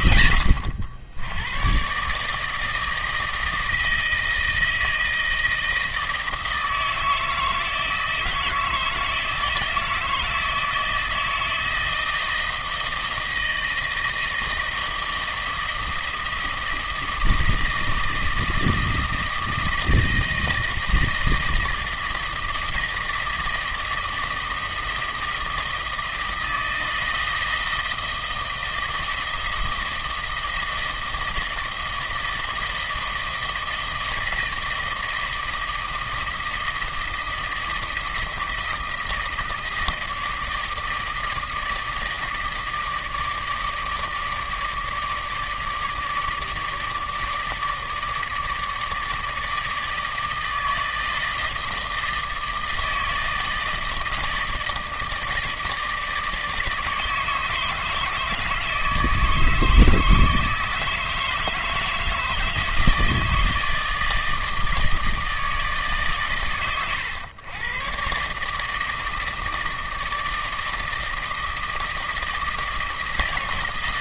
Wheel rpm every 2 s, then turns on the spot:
70, 160, 160, 160, 160, 160, 160, 160, 160, 160, 160, 160, 160, 160, 160, 160, 160, 160, 160, 160, 160, 160, 160, 150, 150, 160, 160, 150, 160, 160, 150, 160, 160, 110, 150, 160, 160.
none